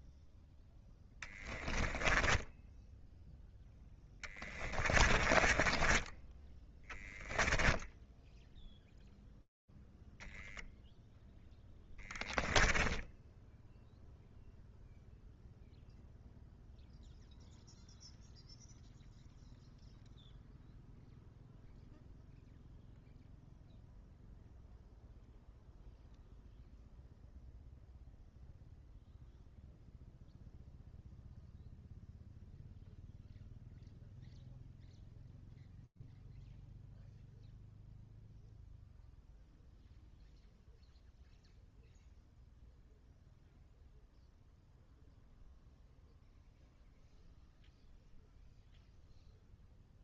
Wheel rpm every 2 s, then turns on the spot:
0, 0, 20, 10, 0, 0, 10, 0, 0, 0, 0, 0, 0, 0, 0, 0, 0, 0, 0, 0, 0, 0, 0, 0, 0.
4-8